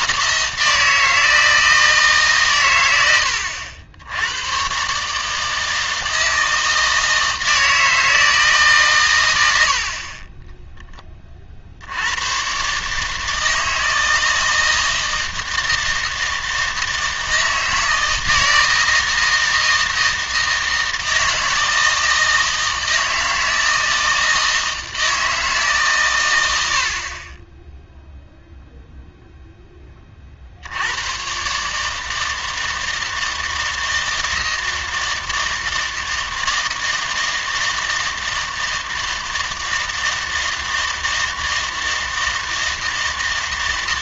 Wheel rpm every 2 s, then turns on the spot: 160, 120, 130, 160, 140, 10, 130, 160, 160, 160, 160, 160, 160, 80, 0, 70, 160, 160, 160, 160, 160, 160.
none